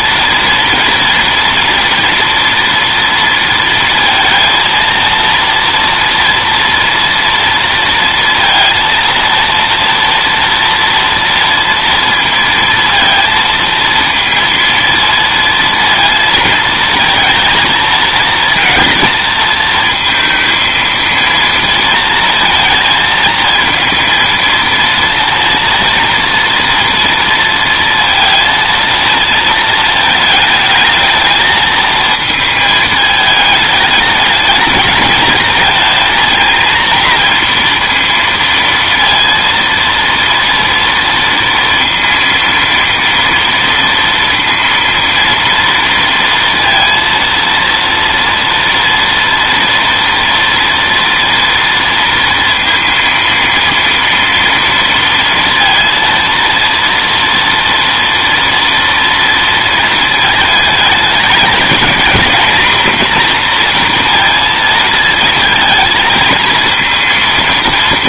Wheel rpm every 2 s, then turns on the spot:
230, 230, 230, 230, 230, 230, 230, 230, 220, 220, 230, 230, 230, 230, 230, 220, 220, 210, 230, 230, 230, 230, 230, 230, 230, 230, 230, 230, 230, 230, 220, 220, 230, 230.
none